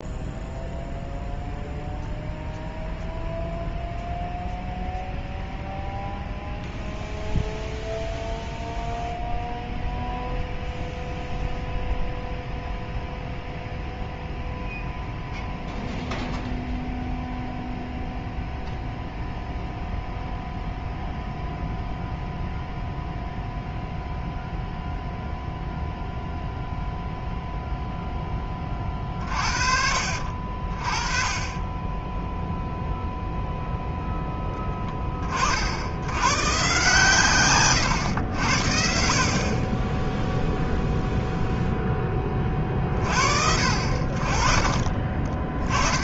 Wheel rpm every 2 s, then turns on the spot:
0, 0, 0, 0, 0, 0, 0, 0, 0, 0, 0, 0, 0, 0, 30, 40, 0, 20, 130, 70, 0, 40, 30.
44-46